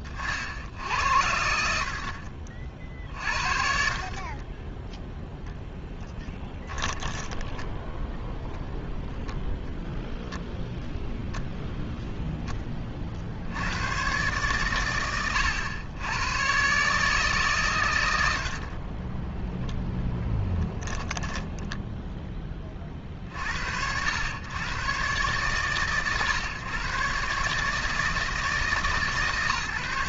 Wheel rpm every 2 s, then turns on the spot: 30, 60, 30, 20, 0, 0, 70, 100, 140, 10, 20, 40, 120, 120, 140.
6-8 20-22